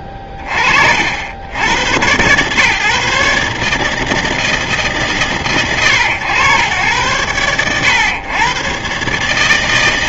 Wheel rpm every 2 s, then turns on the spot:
50, 130, 160, 100, 120.
none